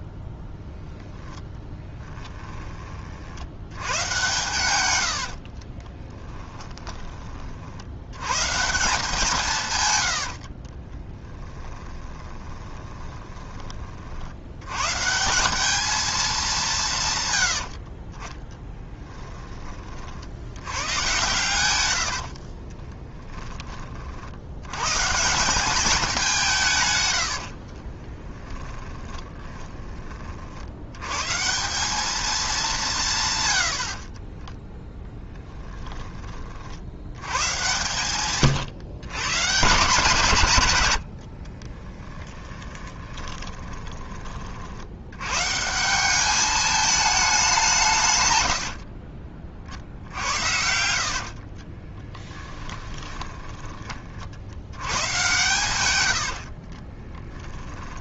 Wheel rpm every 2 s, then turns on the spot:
0, 30, 100, 20, 160, 30, 20, 130, 180, 10, 100, 30, 110, 130, 20, 80, 180, 10, 70, 130, 100, 20, 70, 210, 60, 70, 10, 90, 40.
10-14 18-20 22-24 28-30 42-44 50-54 56-58